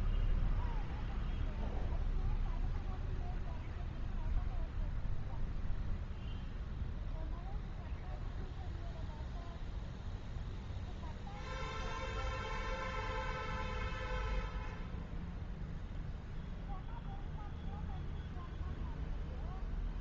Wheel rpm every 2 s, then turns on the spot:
0, 0, 0, 0, 0, 0, 0, 0, 0, 0.
none